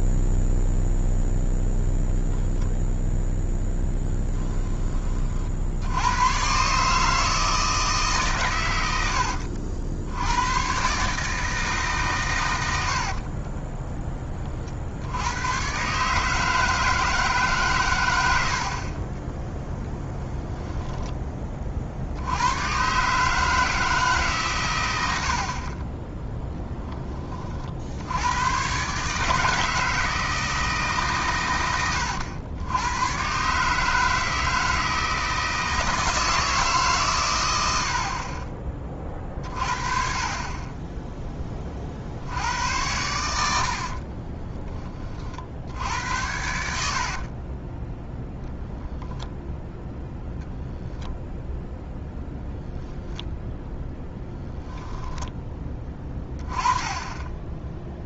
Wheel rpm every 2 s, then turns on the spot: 0, 0, 20, 140, 110, 120, 90, 50, 160, 50, 10, 120, 110, 10, 130, 150, 100, 160, 150, 30, 20, 90, 20, 70, 0, 0, 0, 0, 20.
12-14 46-48